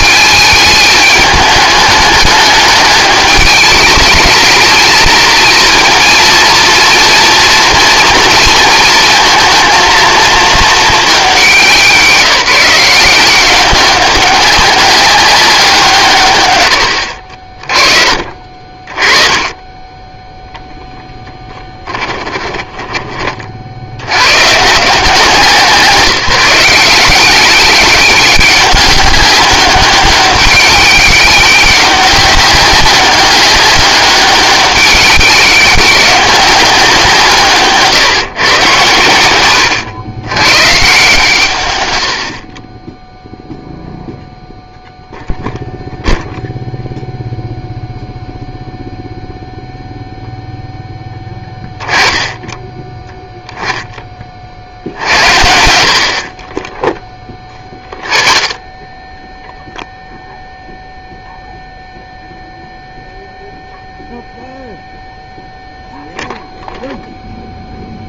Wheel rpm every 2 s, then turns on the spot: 210, 210, 220, 230, 230, 220, 170, 190, 80, 30, 0, 20, 130, 170, 200, 200, 190, 190, 190, 120, 130, 30, 0, 0, 0, 0, 10, 50, 20, 10, 0, 0, 0, 0.
16-18 22-24 56-58